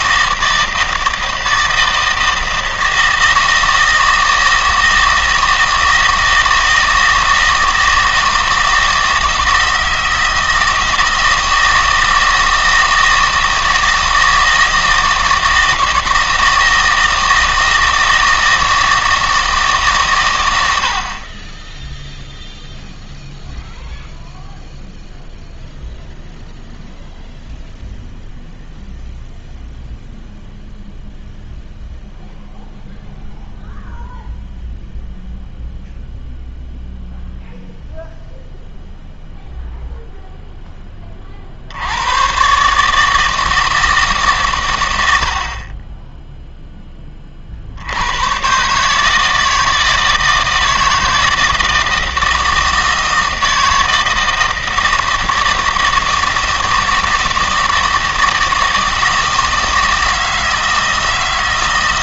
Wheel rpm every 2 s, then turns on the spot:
160, 160, 160, 160, 160, 160, 160, 160, 160, 160, 90, 0, 0, 0, 0, 0, 0, 0, 0, 0, 10, 140, 120, 0, 140, 160, 160, 160, 160, 160, 160.
none